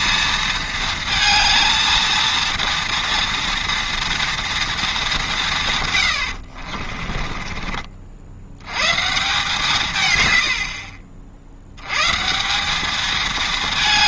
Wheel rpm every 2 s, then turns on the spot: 230, 230, 230, 50, 110, 80, 180.
6-8 10-12